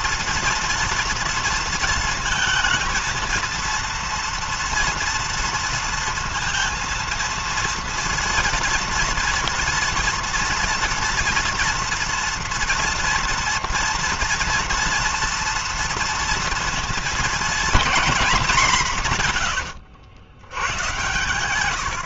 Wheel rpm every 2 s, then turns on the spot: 230, 230, 240, 230, 230, 230, 230, 230, 230, 210, 90.
none